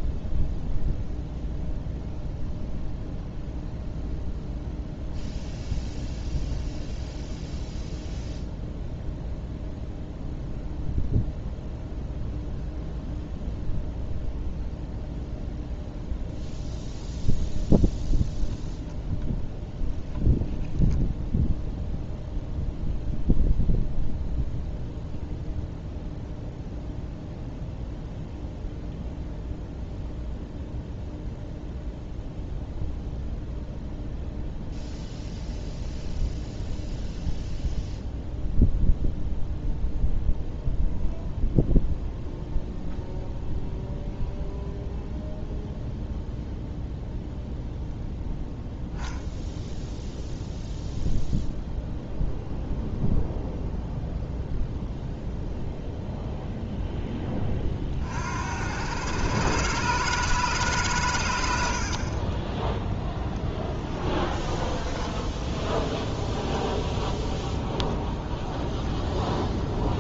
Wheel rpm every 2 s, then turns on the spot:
0, 0, 0, 0, 0, 0, 0, 0, 0, 0, 0, 0, 0, 0, 0, 0, 0, 0, 0, 0, 0, 0, 0, 0, 0, 0, 0, 0, 0, 80, 140, 10, 20, 0, 0.
64-66